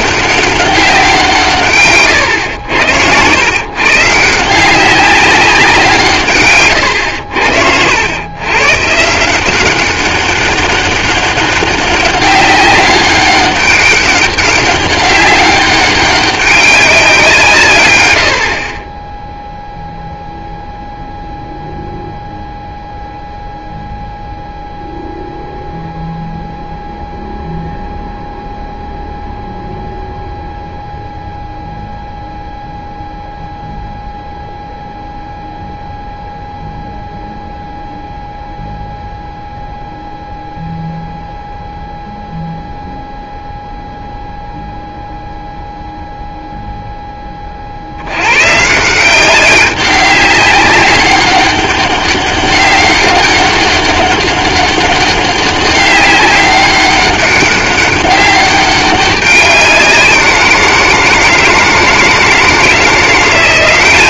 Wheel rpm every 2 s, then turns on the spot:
200, 90, 170, 130, 130, 200, 200, 200, 200, 70, 0, 0, 0, 0, 0, 0, 0, 0, 0, 0, 0, 0, 0, 0, 130, 200, 200, 200, 200, 200, 170, 160.
none